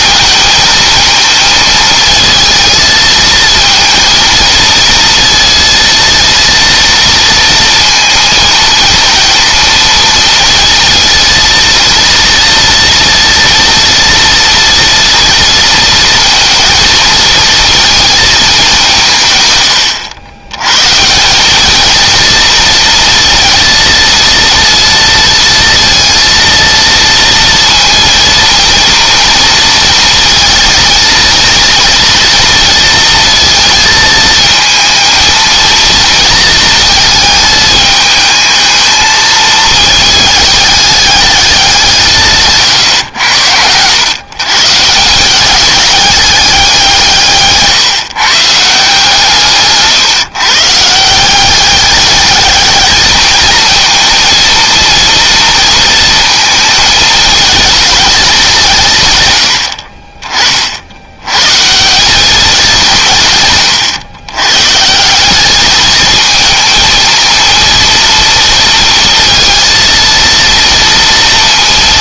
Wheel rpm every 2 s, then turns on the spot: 230, 220, 230, 230, 230, 230, 240, 230, 230, 190, 130, 230, 230, 230, 230, 230, 230, 220, 230, 220, 210, 130, 150, 190, 160, 150, 210, 230, 220, 160, 60, 180, 150, 220, 230, 230.
none